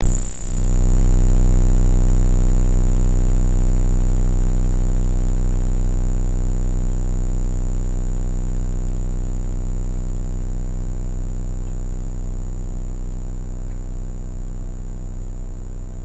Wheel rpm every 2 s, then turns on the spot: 0, 0, 0, 0, 0, 0, 0, 0.
none